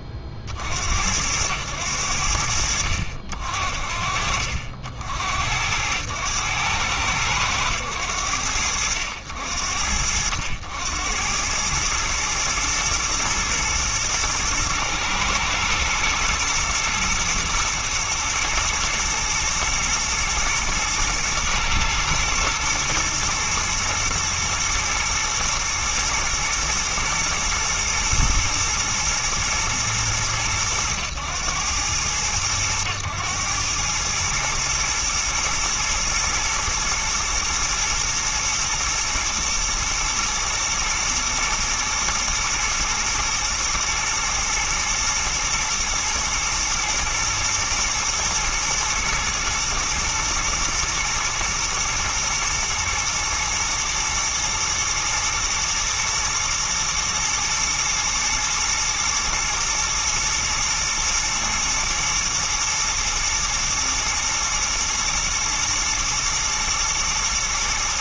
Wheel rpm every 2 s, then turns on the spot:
40, 50, 60, 100, 80, 80, 110, 110, 110, 110, 120, 120, 110, 120, 120, 110, 100, 110, 120, 110, 110, 110, 110, 120, 120, 110, 110, 110, 110, 110, 110, 110, 110, 110.
none